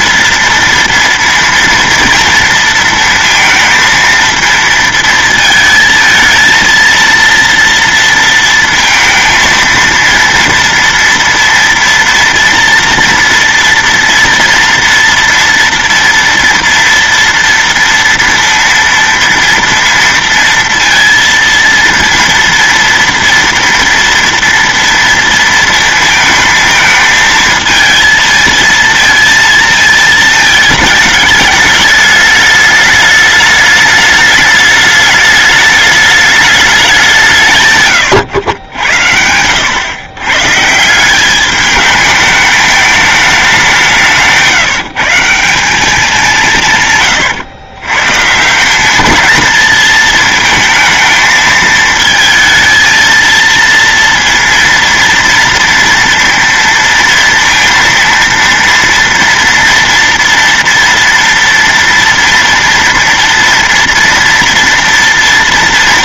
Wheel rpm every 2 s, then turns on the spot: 230, 230, 230, 230, 230, 230, 230, 230, 230, 230, 230, 230, 230, 220, 230, 220, 210, 210, 200, 90, 160, 210, 170, 150, 190, 220, 220, 230, 230, 230, 230, 230, 240.
none